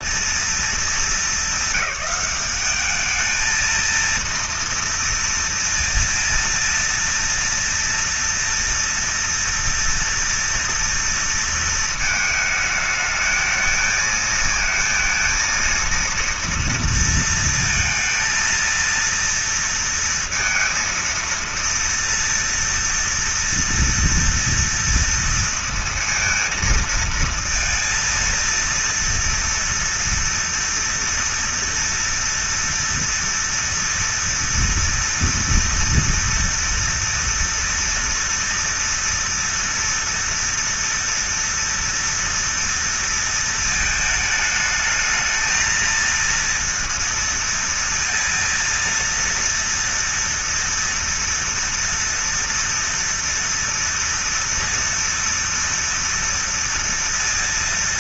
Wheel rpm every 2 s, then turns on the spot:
230, 210, 230, 230, 230, 230, 220, 220, 230, 230, 230, 230, 230, 230, 230, 230, 240, 230, 230, 230, 230, 230, 220, 230, 230, 230, 230, 230, 240.
none